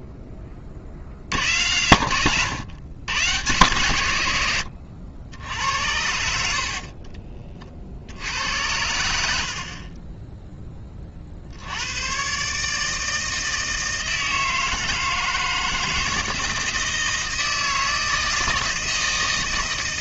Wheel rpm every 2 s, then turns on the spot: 50, 120, 120, 70, 80, 20, 150, 160, 160, 160.
6-8